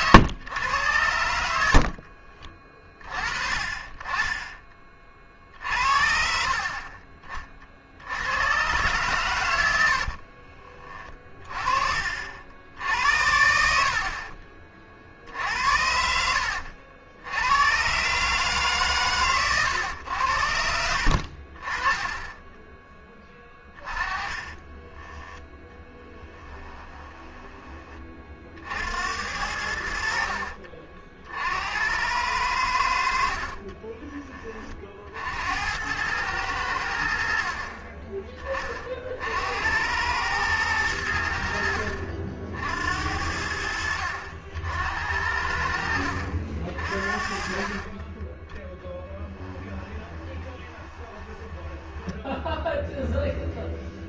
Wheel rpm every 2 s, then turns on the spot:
120, 40, 20, 50, 120, 40, 70, 50, 70, 140, 80, 10, 20, 10, 50, 50, 80, 30, 90, 30, 110, 70, 70, 60, 10, 20, 10.
10-12 22-28 50-52